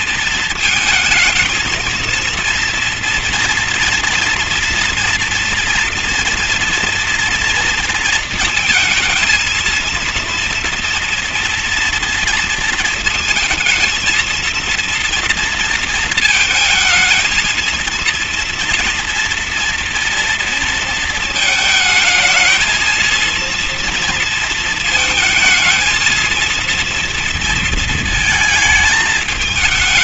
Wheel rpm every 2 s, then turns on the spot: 230, 230, 230, 230, 230, 240, 230, 230, 230, 230, 230, 220, 220, 230, 220.
none